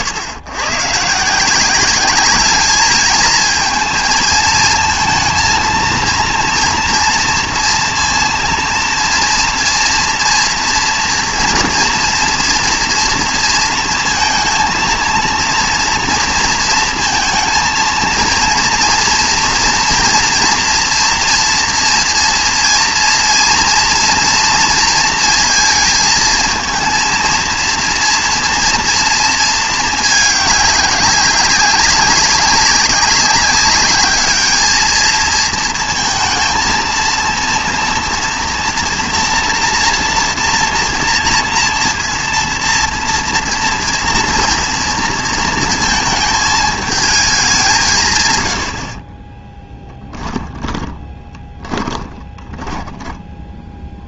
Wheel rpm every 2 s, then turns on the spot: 120, 210, 230, 230, 230, 230, 240, 230, 230, 230, 240, 230, 230, 230, 230, 200, 190, 210, 230, 230, 230, 230, 230, 220, 100, 10, 20.
50-54